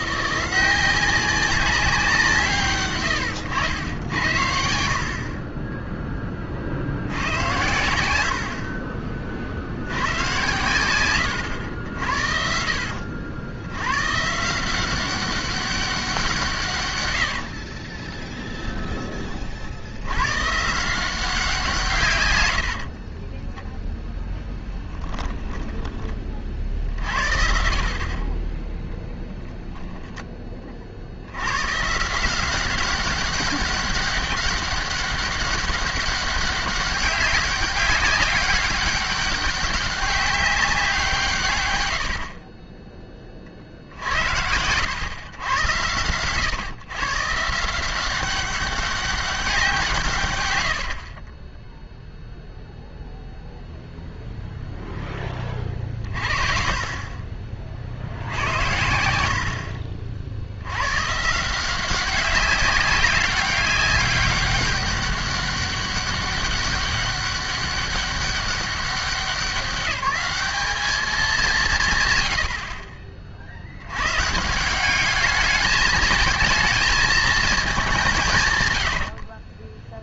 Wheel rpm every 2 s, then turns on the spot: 190, 130, 60, 80, 40, 110, 70, 180, 130, 20, 160, 60, 10, 60, 10, 40, 190, 200, 190, 200, 180, 20, 110, 130, 200, 80, 0, 0, 40, 80, 110, 200, 200, 200, 190, 200, 50, 190, 220, 90.
22-26 50-52 78-80